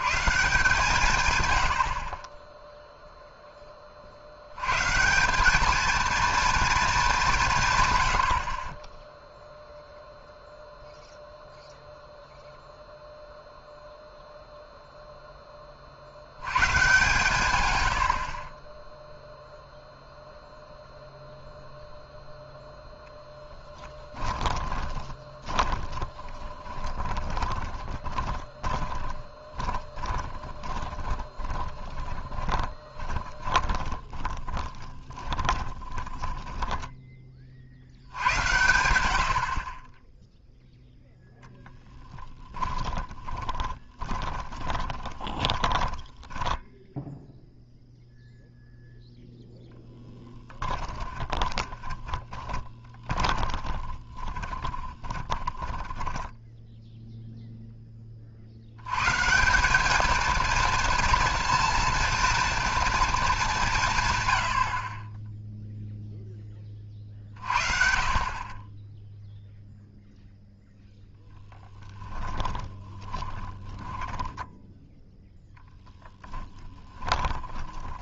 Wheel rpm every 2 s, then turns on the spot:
150, 0, 120, 230, 30, 0, 0, 0, 130, 20, 0, 0, 20, 30, 20, 20, 20, 30, 10, 80, 0, 20, 20, 10, 0, 10, 20, 20, 0, 80, 230, 230, 60, 20, 20, 0, 10, 10, 10.
24-38 42-46 50-56 72-78